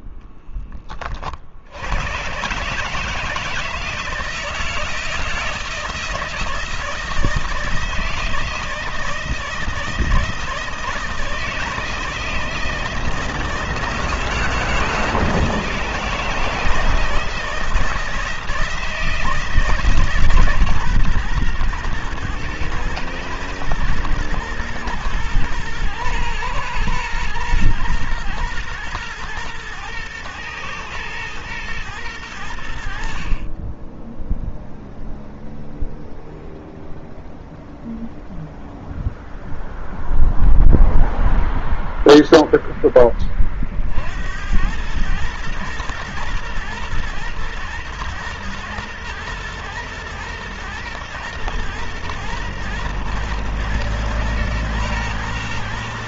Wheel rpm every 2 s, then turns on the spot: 50, 160, 160, 160, 160, 160, 170, 160, 160, 160, 130, 110, 110, 110, 110, 110, 60, 0, 0, 0, 0, 20, 110, 120, 120, 110, 120, 120.
none